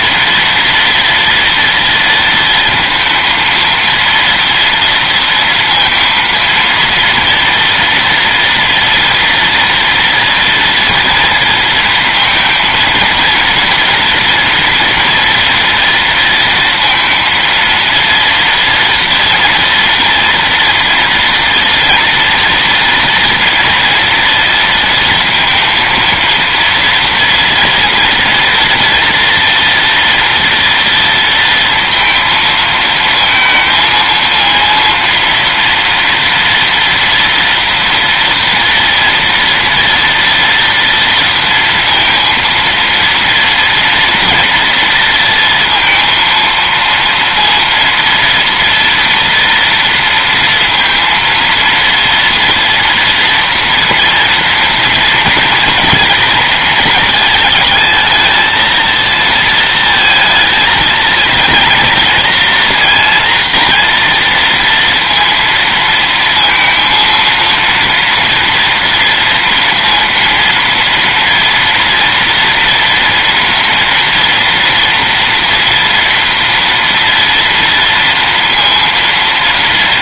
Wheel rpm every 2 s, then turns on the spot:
230, 230, 230, 230, 230, 230, 230, 240, 230, 230, 240, 230, 230, 230, 230, 230, 230, 230, 230, 230, 230, 230, 230, 230, 240, 230, 230, 230, 220, 230, 230, 240, 230, 230, 230, 230, 230, 230, 230, 230.
none